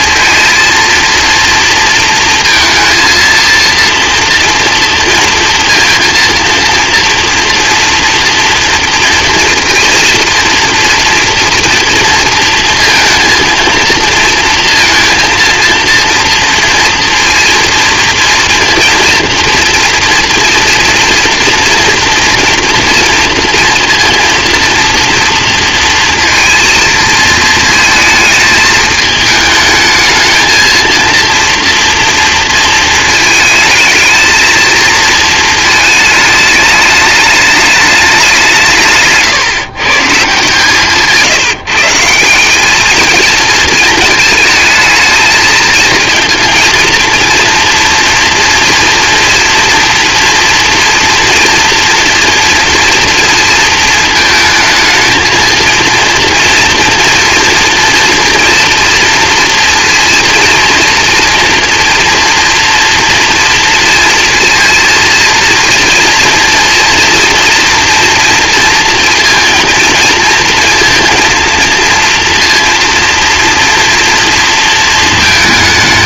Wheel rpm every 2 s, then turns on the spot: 230, 230, 230, 230, 230, 230, 230, 230, 230, 230, 240, 230, 230, 230, 220, 230, 230, 220, 210, 170, 150, 200, 220, 230, 230, 230, 230, 220, 230, 230, 230, 230, 230, 230, 230, 230, 230, 230.
none